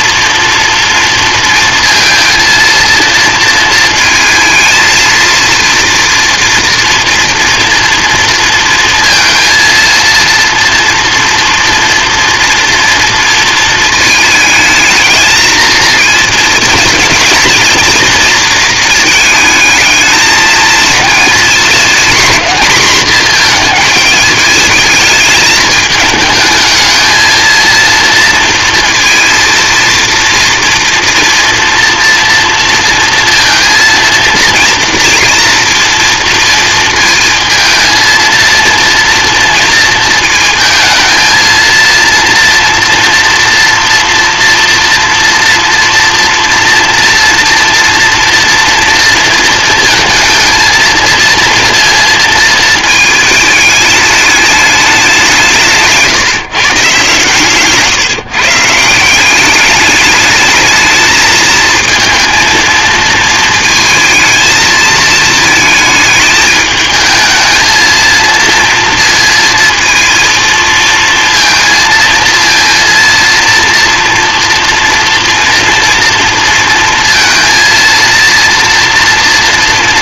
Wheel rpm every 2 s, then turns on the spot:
230, 230, 220, 230, 230, 230, 230, 220, 220, 220, 220, 230, 210, 220, 230, 230, 230, 230, 230, 230, 230, 230, 230, 230, 230, 230, 230, 210, 140, 160, 220, 230, 220, 220, 230, 230, 230, 230, 230, 230.
none